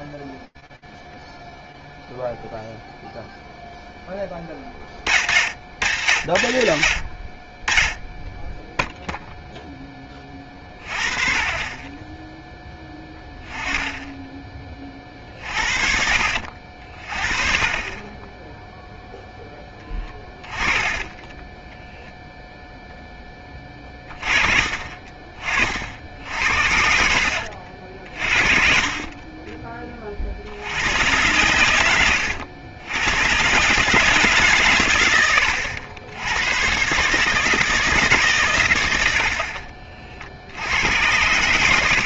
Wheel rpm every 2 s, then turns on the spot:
0, 0, 10, 80, 0, 30, 10, 30, 40, 0, 20, 10, 30, 60, 30, 100, 100, 100, 140, 80, 110.
20-22 26-28